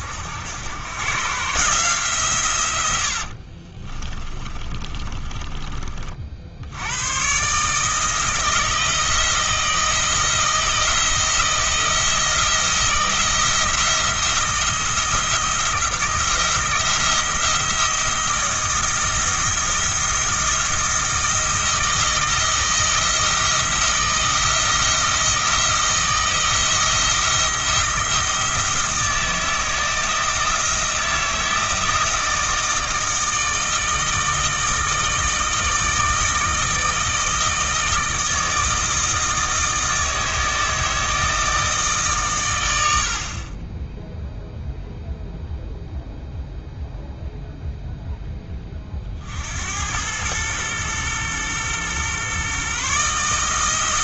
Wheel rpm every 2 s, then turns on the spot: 100, 100, 30, 80, 160, 170, 170, 170, 170, 170, 170, 160, 160, 170, 170, 170, 160, 160, 160, 160, 160, 90, 0, 0, 30, 110, 140.
4-6